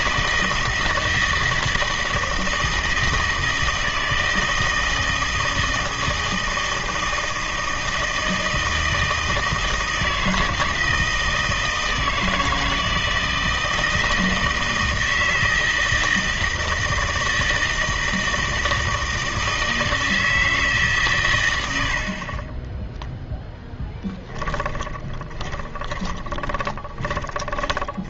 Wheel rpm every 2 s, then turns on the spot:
160, 160, 160, 160, 160, 160, 160, 160, 160, 160, 160, 20, 10, 20.
24-28